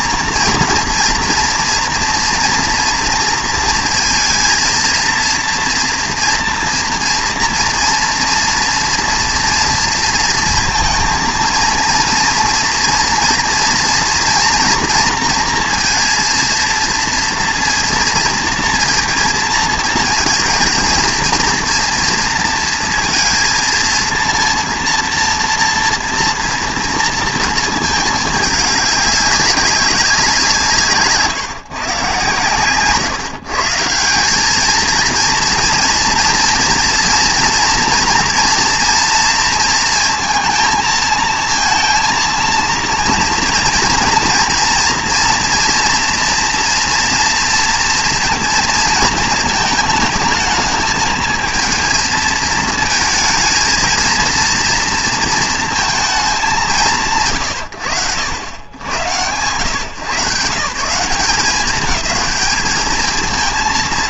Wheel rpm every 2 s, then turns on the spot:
240, 240, 230, 230, 230, 230, 230, 230, 230, 230, 230, 230, 230, 230, 210, 170, 130, 210, 230, 240, 230, 230, 230, 240, 230, 220, 220, 230, 200, 90, 160, 210.
none